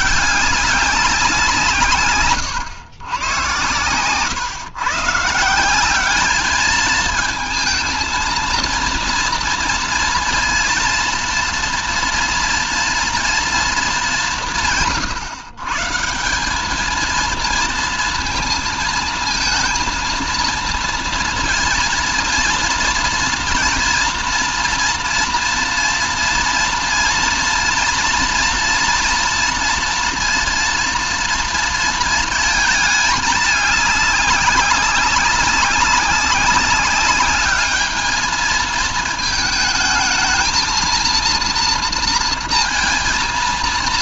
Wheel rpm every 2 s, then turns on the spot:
200, 120, 150, 220, 230, 240, 230, 150, 220, 230, 230, 230, 230, 230, 230, 230, 220, 200, 200, 220, 230, 230.
none